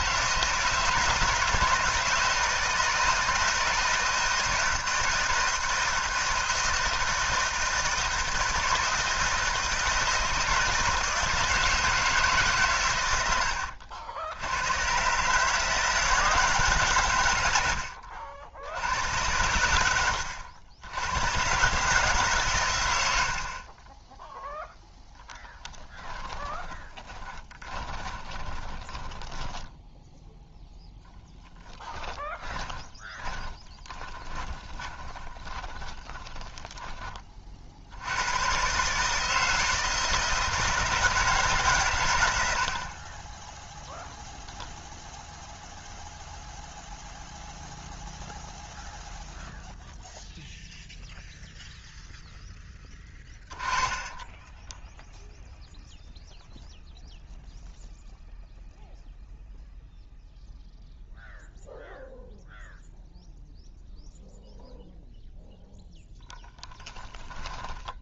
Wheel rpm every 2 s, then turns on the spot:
160, 160, 160, 160, 160, 160, 120, 100, 140, 90, 70, 110, 0, 20, 20, 0, 20, 20, 10, 130, 160, 70, 0, 0, 0, 0, 10, 10, 0, 0, 0, 0, 0, 10.
26-30 32-36 54-56 66-68